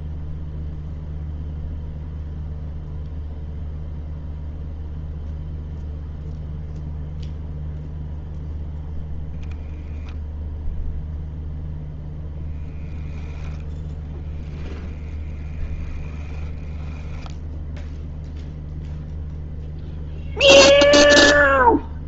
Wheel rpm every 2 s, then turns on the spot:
0, 0, 0, 0, 0, 0, 0, 0, 10, 0, 0.
none